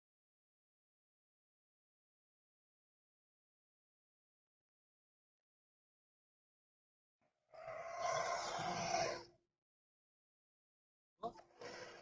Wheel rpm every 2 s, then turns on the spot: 0, 0, 0, 0, 0, 0.
none